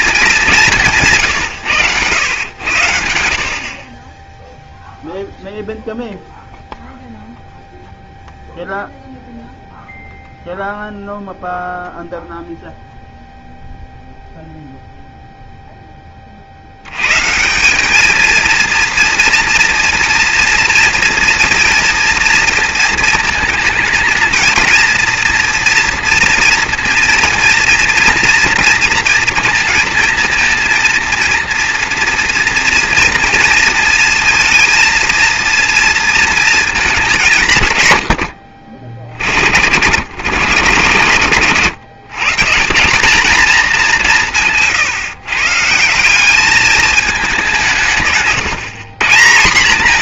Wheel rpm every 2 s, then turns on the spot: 180, 110, 0, 0, 0, 0, 0, 0, 60, 230, 230, 230, 230, 240, 230, 230, 230, 230, 220, 80, 120, 160, 140, 210, 150.
none